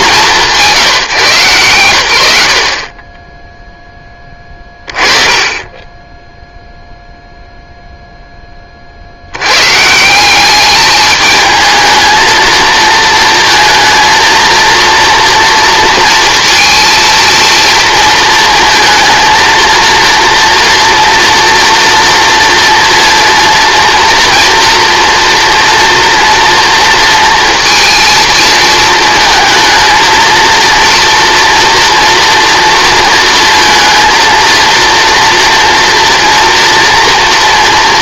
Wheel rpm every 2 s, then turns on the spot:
160, 50, 20, 0, 10, 200, 230, 230, 230, 220, 230, 230, 230, 230, 230, 230, 230, 230, 230.
none